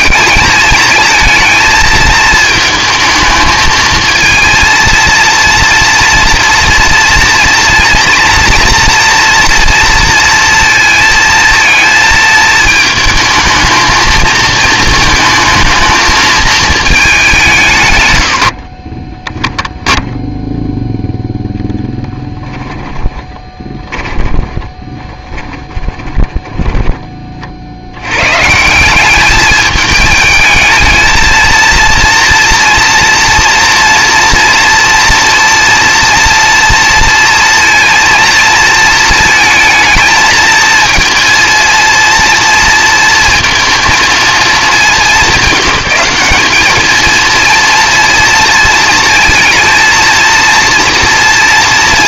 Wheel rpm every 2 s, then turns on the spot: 220, 220, 230, 230, 230, 230, 220, 220, 220, 70, 0, 10, 20, 20, 150, 220, 230, 230, 230, 230, 220, 230, 220, 210, 220, 230.
18-20 22-28